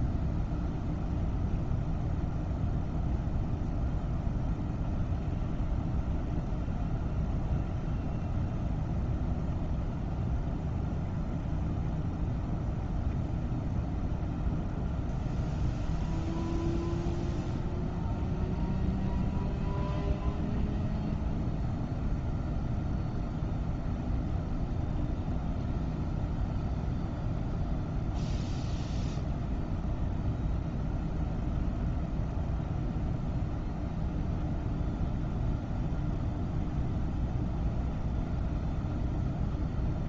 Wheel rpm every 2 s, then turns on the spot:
0, 0, 0, 0, 0, 0, 0, 0, 0, 0, 0, 0, 0, 0, 0, 0, 0, 0, 0, 0.
none